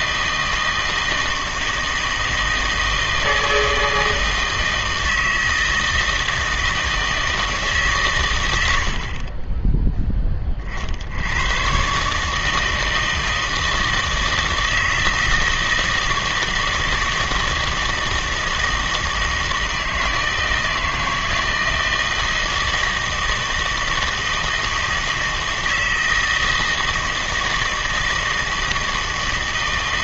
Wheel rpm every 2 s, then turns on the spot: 160, 160, 160, 160, 100, 30, 160, 160, 160, 160, 160, 160, 160, 160, 160.
none